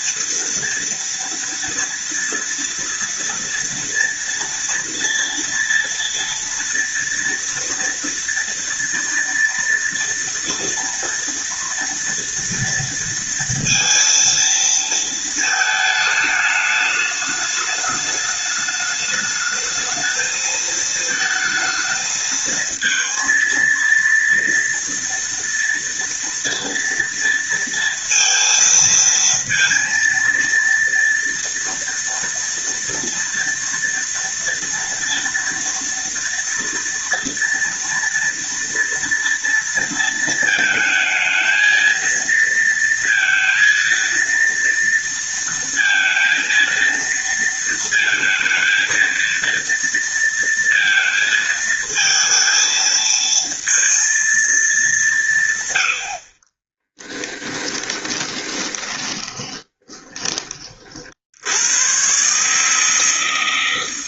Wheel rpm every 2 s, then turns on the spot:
230, 230, 230, 230, 230, 230, 230, 230, 210, 210, 220, 220, 230, 230, 230, 230, 230, 230, 230, 230, 220, 230, 230, 230, 220, 220, 230, 190, 10, 20, 40, 160.
56-60